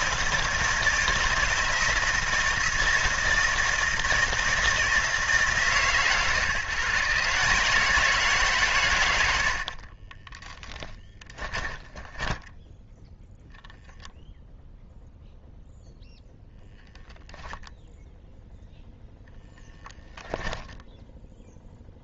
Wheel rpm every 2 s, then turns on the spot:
160, 160, 160, 150, 140, 10, 10, 0, 0, 0, 10.
10-14